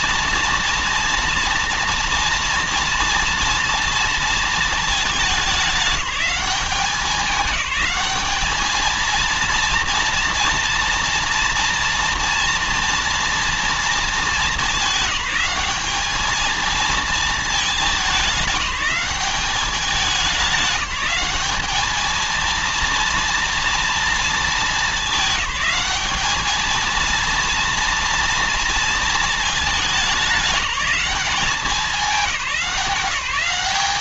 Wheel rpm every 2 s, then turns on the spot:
230, 230, 210, 200, 230, 230, 230, 190, 220, 200, 200, 240, 210, 230, 220, 200, 190.
none